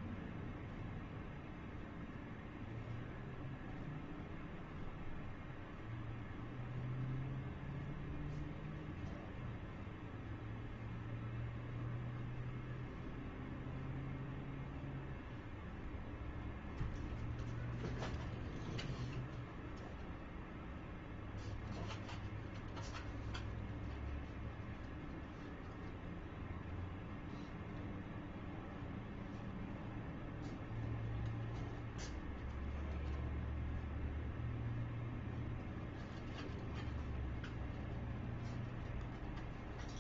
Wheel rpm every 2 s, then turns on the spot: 0, 0, 0, 0, 0, 0, 0, 0, 0, 0, 0, 0, 0, 0, 0, 0, 0, 0, 0, 0.
none